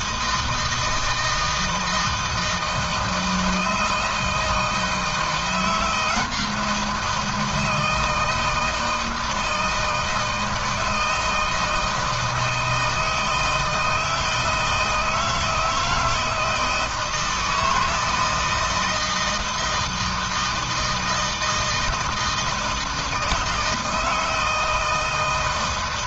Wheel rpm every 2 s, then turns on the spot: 160, 160, 160, 170, 160, 160, 160, 160, 160, 160, 160, 160, 160.
none